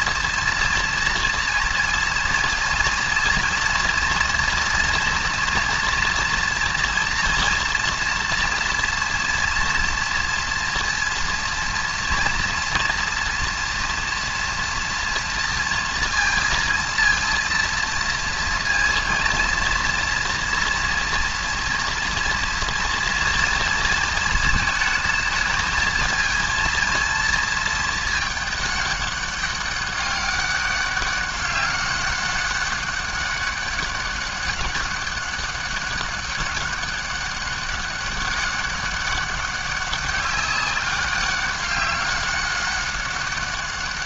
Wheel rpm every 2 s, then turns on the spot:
230, 230, 230, 240, 230, 230, 230, 230, 230, 230, 230, 230, 220, 230, 200, 200, 200, 200, 200, 200, 200, 200.
none